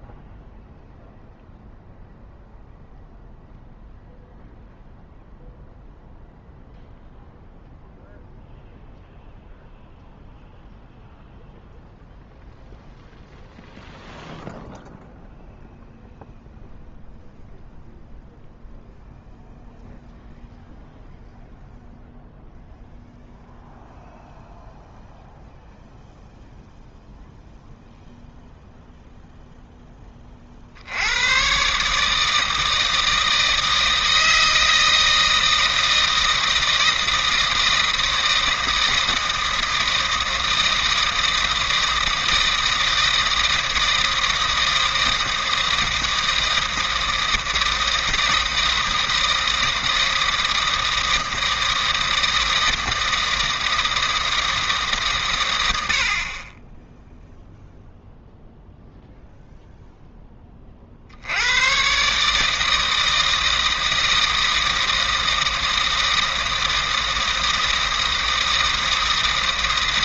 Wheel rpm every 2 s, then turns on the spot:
0, 0, 0, 0, 0, 0, 0, 0, 0, 0, 0, 0, 0, 0, 0, 70, 160, 160, 160, 160, 160, 160, 160, 160, 160, 160, 160, 150, 10, 0, 50, 160, 160, 160, 160.
none